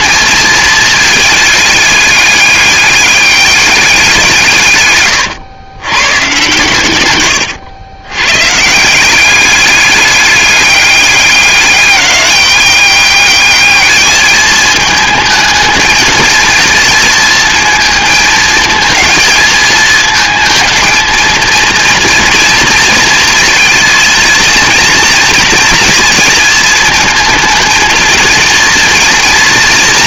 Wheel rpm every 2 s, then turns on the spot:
220, 210, 150, 120, 160, 200, 200, 220, 220, 220, 220, 230, 230, 220, 230.
none